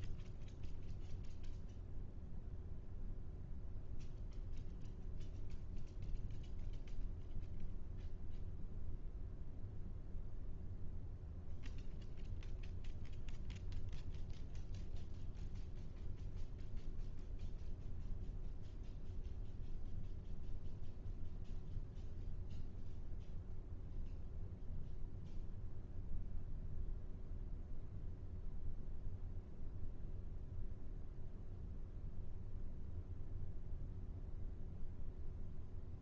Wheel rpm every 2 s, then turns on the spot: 0, 0, 0, 0, 0, 0, 0, 0, 0, 0, 0, 0, 0, 0, 0, 0, 0, 0.
none